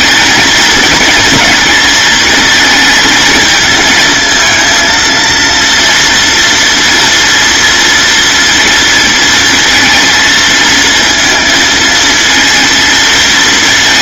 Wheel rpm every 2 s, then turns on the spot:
230, 220, 230, 230, 230, 230, 220.
none